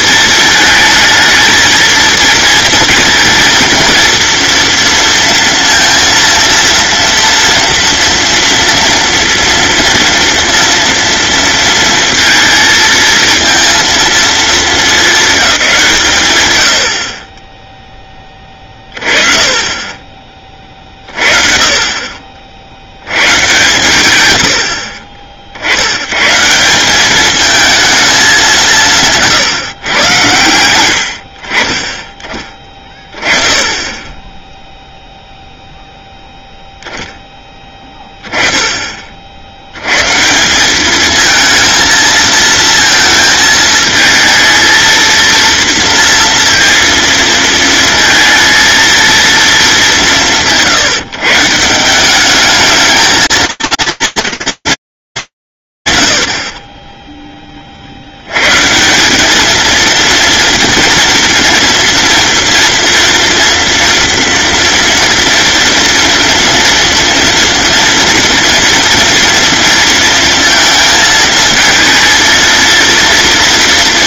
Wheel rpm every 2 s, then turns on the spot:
220, 230, 230, 230, 230, 230, 230, 200, 40, 20, 30, 80, 60, 180, 170, 80, 20, 0, 0, 20, 190, 230, 230, 230, 230, 150, 220, 230, 40, 130, 230, 230, 240, 230, 230, 230, 230.
none